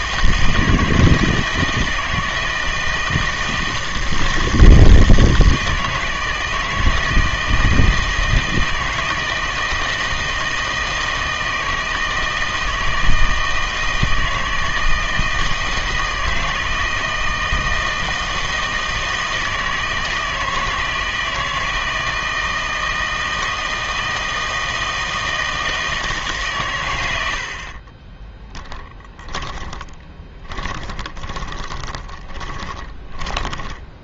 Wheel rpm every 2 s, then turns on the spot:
160, 160, 160, 160, 160, 160, 160, 160, 160, 160, 160, 160, 160, 120, 10, 20, 20.
28-34